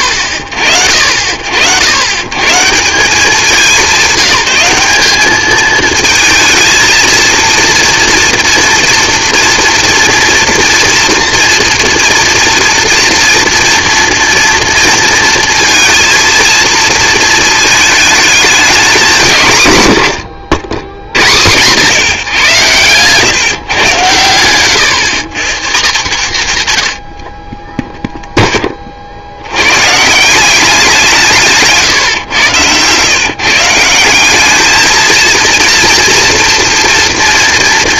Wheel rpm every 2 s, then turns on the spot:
60, 160, 190, 230, 230, 230, 230, 230, 230, 230, 120, 130, 120, 120, 30, 180, 120, 210, 230.
none